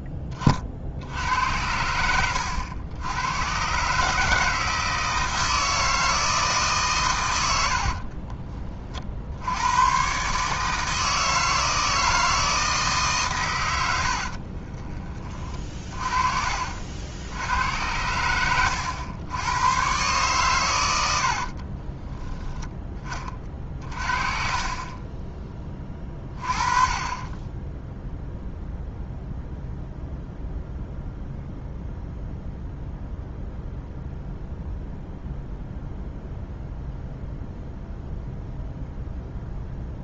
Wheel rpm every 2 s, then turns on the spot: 40, 90, 160, 150, 30, 140, 160, 40, 50, 100, 120, 10, 40, 30, 0, 0, 0, 0, 0, 0.
0-2 14-16